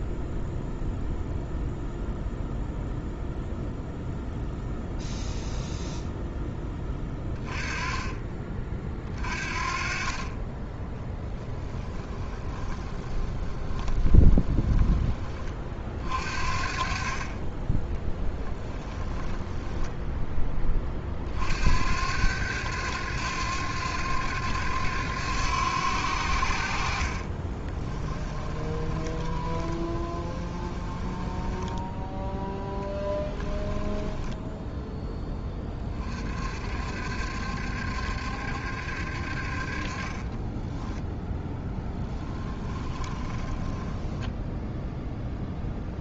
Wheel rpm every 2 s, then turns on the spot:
0, 0, 0, 10, 40, 10, 20, 20, 40, 20, 30, 90, 90, 50, 20, 20, 10, 10, 60, 60, 10, 20, 0.
12-14 18-20 28-34 42-44